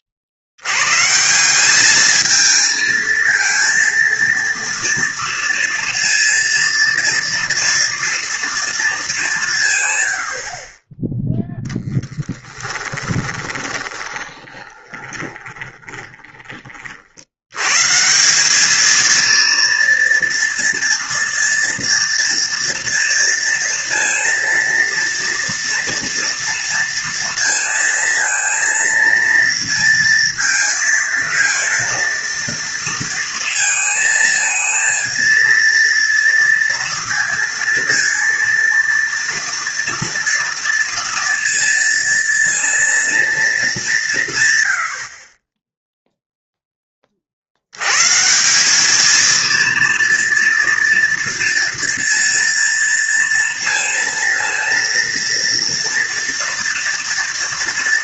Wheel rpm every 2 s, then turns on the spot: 70, 220, 230, 230, 230, 40, 20, 20, 30, 210, 230, 230, 230, 230, 230, 230, 230, 220, 230, 230, 230, 230, 100, 10, 200, 230, 230, 230, 240.
12-16